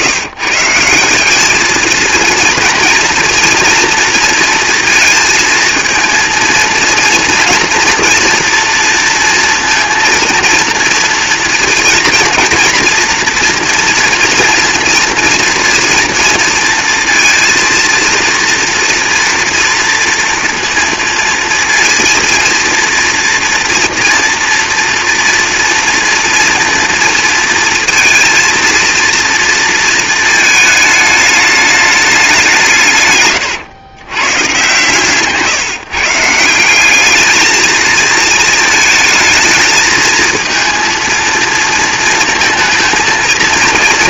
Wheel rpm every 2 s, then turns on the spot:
160, 230, 230, 230, 230, 230, 230, 230, 230, 230, 230, 230, 240, 230, 230, 210, 170, 140, 190, 220, 230, 220.
none